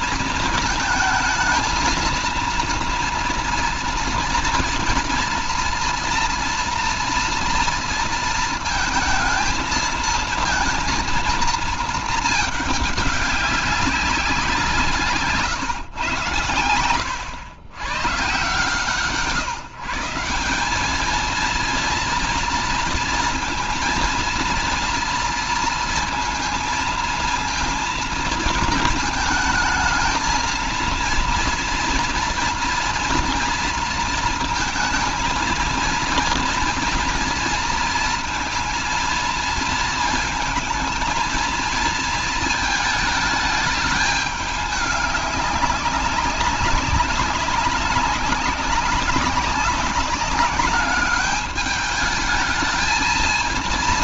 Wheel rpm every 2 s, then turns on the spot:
220, 230, 230, 240, 220, 230, 210, 180, 100, 140, 200, 230, 230, 230, 220, 230, 230, 230, 230, 230, 220, 220, 210, 190, 190, 200, 220.
none